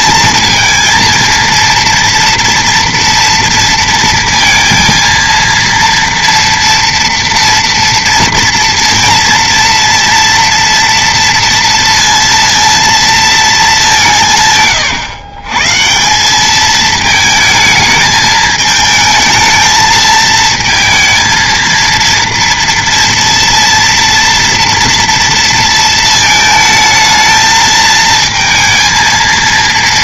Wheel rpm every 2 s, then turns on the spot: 230, 240, 230, 230, 230, 230, 230, 130, 210, 220, 220, 230, 230, 220, 230.
none